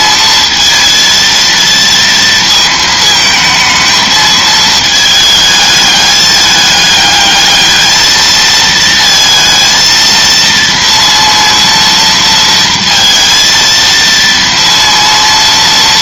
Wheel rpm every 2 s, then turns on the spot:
230, 220, 220, 210, 220, 230, 230, 230.
none